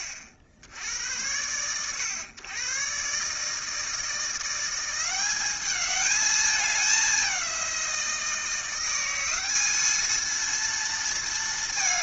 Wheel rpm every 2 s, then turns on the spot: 90, 120, 180, 200, 180, 230.
none